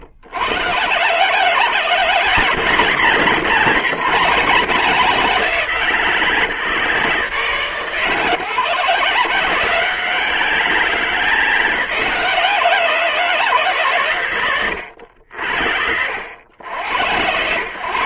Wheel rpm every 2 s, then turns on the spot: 90, 150, 150, 130, 120, 150, 140, 90, 70.
none